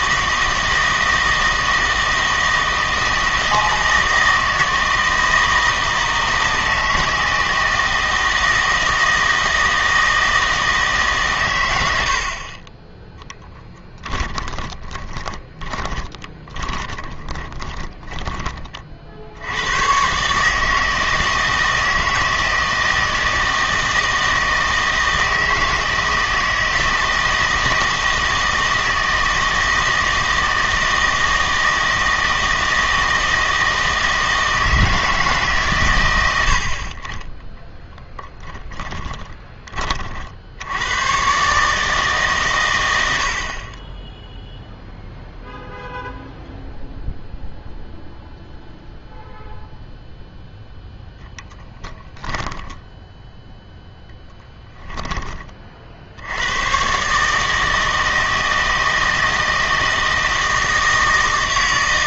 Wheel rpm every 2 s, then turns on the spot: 160, 160, 160, 160, 160, 150, 20, 30, 20, 30, 160, 160, 160, 160, 160, 160, 160, 160, 50, 20, 90, 100, 0, 0, 0, 0, 10, 10, 120, 160, 160.
14-18 38-40 52-56